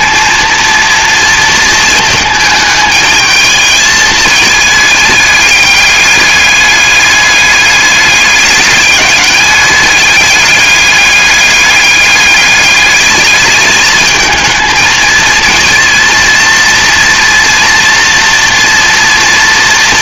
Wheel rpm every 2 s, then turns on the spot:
230, 220, 220, 210, 210, 200, 200, 220, 230, 240.
none